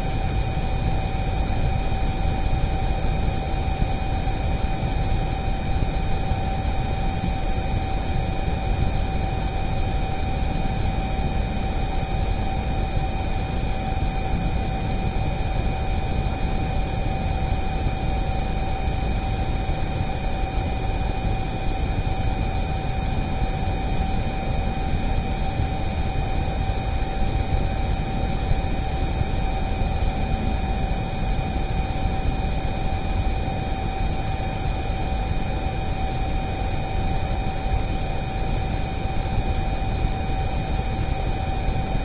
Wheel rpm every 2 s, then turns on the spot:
0, 0, 0, 0, 0, 0, 0, 0, 0, 0, 0, 0, 0, 0, 0, 0, 0, 0, 0, 0, 0.
none